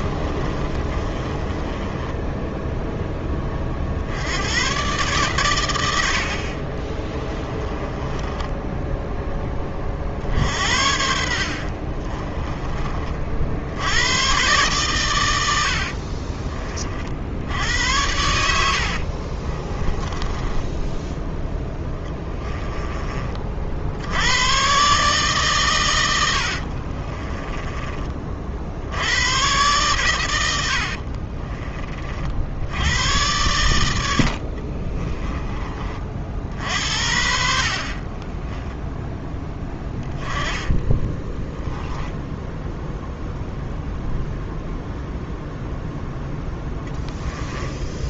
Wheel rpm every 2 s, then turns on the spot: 30, 10, 130, 30, 10, 60, 30, 120, 50, 60, 10, 20, 140, 40, 80, 60, 100, 30, 60, 10, 20, 0, 0, 10.
0-2 6-8 18-24 26-28 30-32 34-36 40-42 46-48